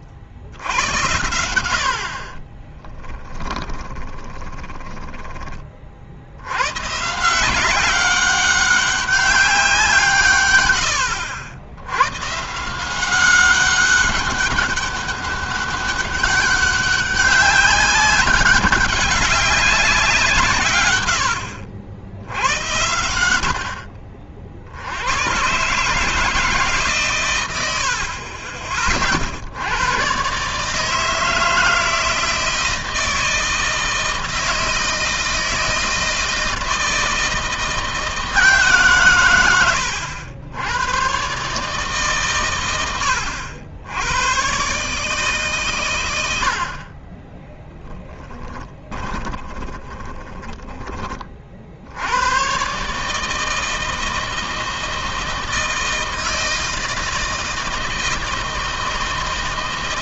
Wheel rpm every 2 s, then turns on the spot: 100, 20, 10, 130, 190, 90, 170, 200, 200, 190, 110, 100, 90, 130, 40, 150, 160, 160, 160, 140, 120, 100, 140, 40, 10, 20, 140, 160, 160, 160.
2-4 20-22 46-50